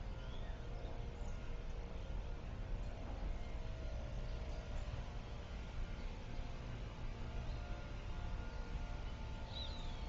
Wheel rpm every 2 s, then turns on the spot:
0, 0, 0, 0, 0.
none